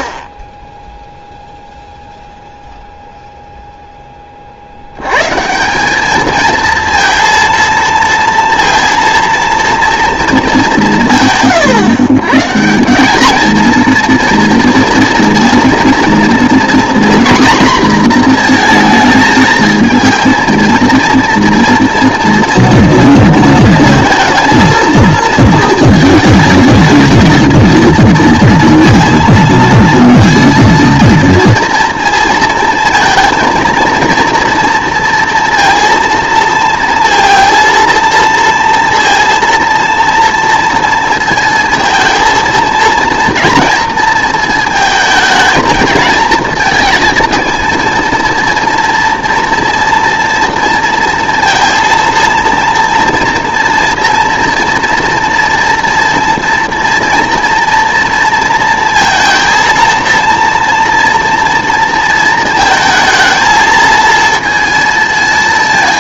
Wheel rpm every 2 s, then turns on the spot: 0, 0, 70, 220, 230, 200, 170, 230, 240, 230, 230, 230, 230, 220, 230, 230, 230, 230, 230, 230, 230, 230, 230, 230, 230, 230, 230, 230, 240, 230, 230, 220, 230.
none